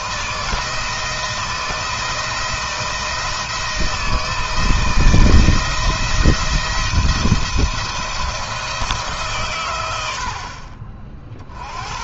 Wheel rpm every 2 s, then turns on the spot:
170, 170, 170, 170, 160, 40.
none